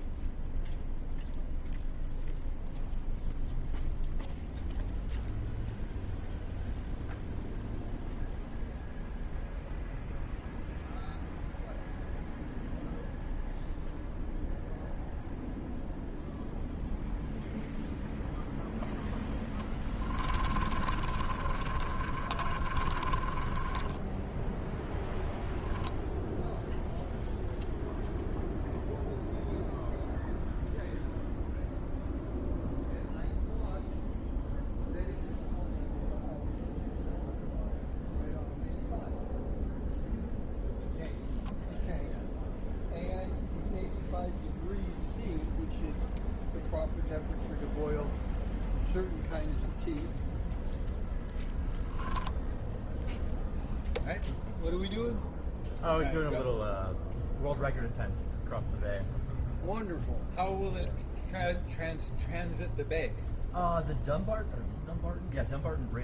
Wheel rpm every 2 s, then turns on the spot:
0, 0, 0, 0, 0, 0, 0, 0, 0, 0, 30, 30, 0, 0, 0, 0, 0, 0, 0, 0, 0, 0, 0, 0, 0, 0, 0, 0, 0, 0, 0, 0, 0.
20-24